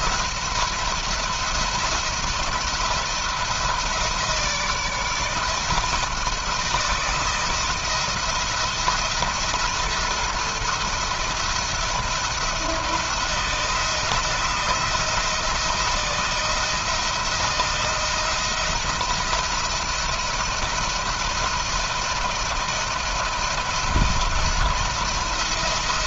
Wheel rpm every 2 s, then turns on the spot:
170, 170, 160, 160, 170, 170, 170, 160, 170, 170, 170, 170, 170.
none